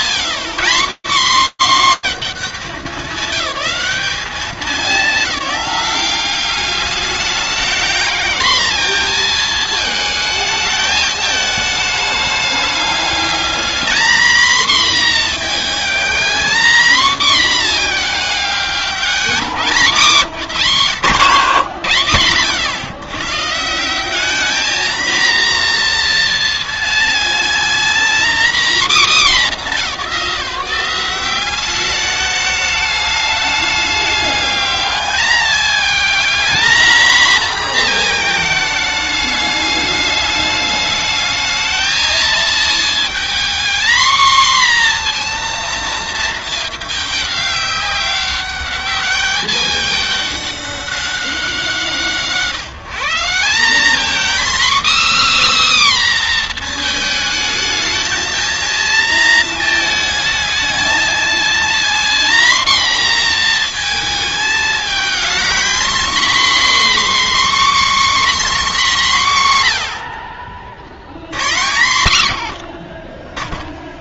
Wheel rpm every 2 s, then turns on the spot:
220, 220, 210, 200, 230, 220, 210, 240, 240, 200, 130, 120, 220, 230, 240, 190, 210, 210, 230, 220, 210, 230, 240, 220, 200, 200, 160, 290, 240, 230, 220, 240, 220, 280, 240, 70, 20.
none